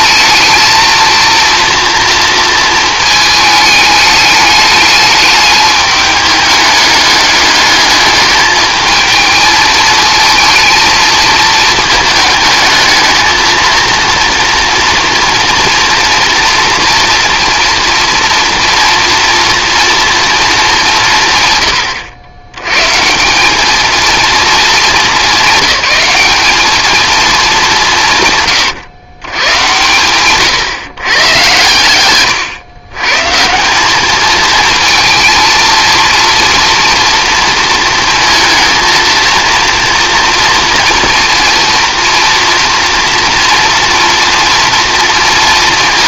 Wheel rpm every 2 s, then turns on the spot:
230, 220, 210, 210, 220, 220, 220, 230, 230, 230, 200, 110, 200, 210, 120, 120, 130, 220, 230, 220, 230, 240, 230.
none